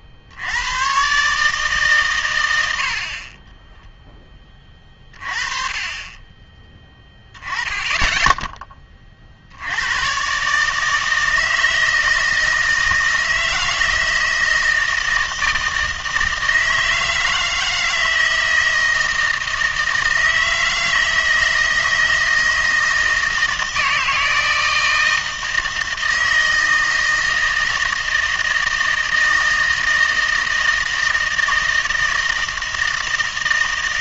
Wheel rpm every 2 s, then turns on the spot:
90, 90, 20, 20, 10, 150, 160, 160, 160, 160, 160, 160, 160, 160, 160, 160, 160.
none